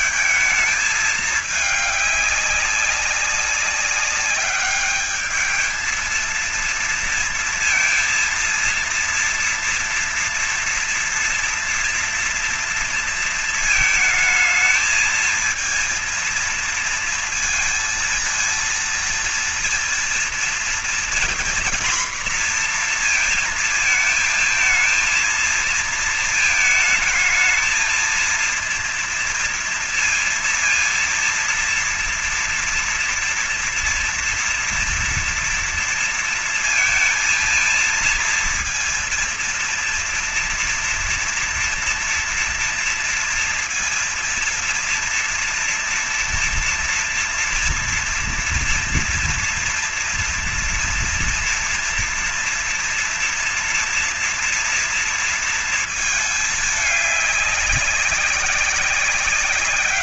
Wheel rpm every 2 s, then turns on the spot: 220, 200, 200, 230, 230, 230, 230, 220, 230, 230, 240, 240, 230, 220, 230, 230, 230, 230, 230, 230, 230, 230, 240, 240, 230, 230, 240, 230, 210, 200.
none